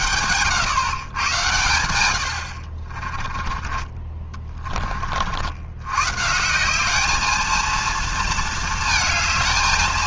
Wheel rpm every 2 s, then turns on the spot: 110, 70, 30, 180, 230.
none